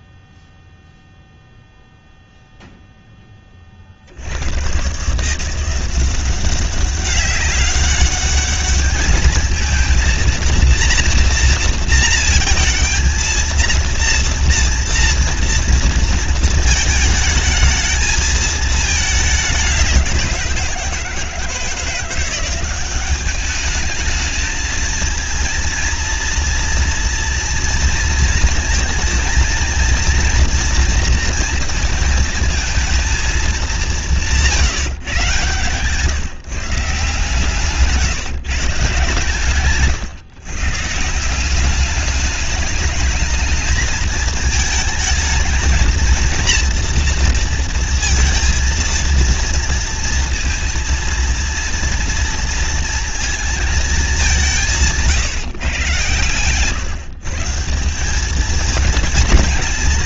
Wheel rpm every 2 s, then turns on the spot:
0, 0, 120, 190, 210, 230, 230, 230, 220, 220, 170, 190, 220, 230, 230, 240, 220, 160, 150, 140, 150, 210, 220, 230, 230, 230, 230, 170, 130, 220.
none